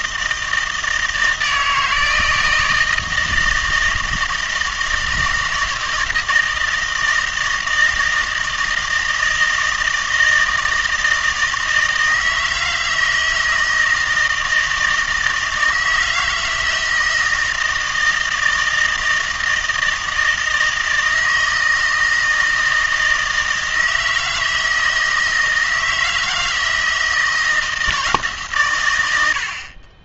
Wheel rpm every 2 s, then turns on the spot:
160, 160, 160, 160, 160, 160, 160, 160, 170, 160, 160, 160, 160, 160, 110.
none